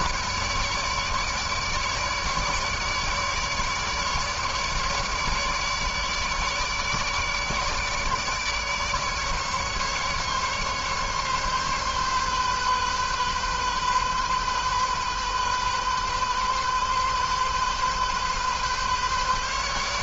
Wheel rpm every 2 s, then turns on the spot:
150, 150, 150, 150, 150, 140, 130, 130, 130, 140.
none